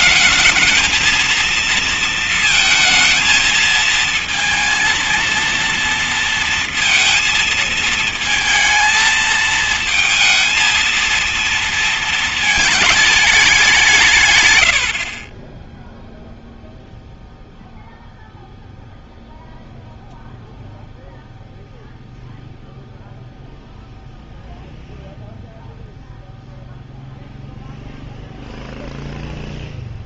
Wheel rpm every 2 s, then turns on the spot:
220, 230, 230, 230, 220, 230, 220, 120, 0, 0, 0, 0, 0, 0, 0.
none